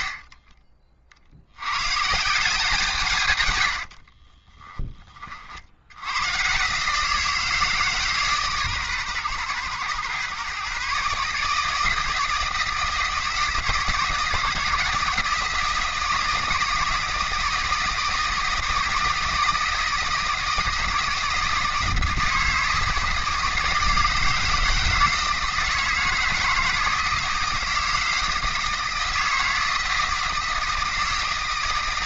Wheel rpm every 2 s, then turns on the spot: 50, 170, 20, 140, 140, 130, 160, 160, 160, 160, 160, 160, 160, 160, 160, 160.
0-2 4-6